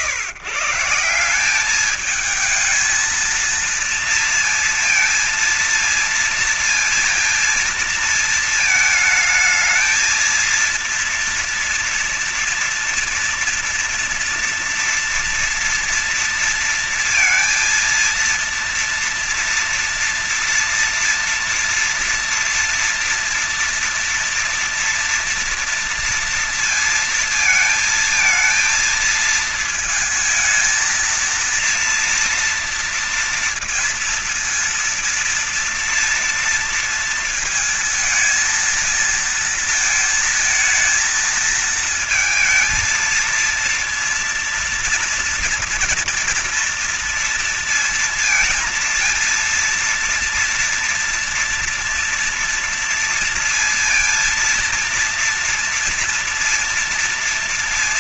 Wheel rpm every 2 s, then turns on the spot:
160, 210, 230, 230, 220, 230, 230, 230, 230, 230, 230, 230, 240, 230, 230, 230, 230, 230, 230, 230, 230, 220, 240, 240, 230, 230, 230, 230, 230.
none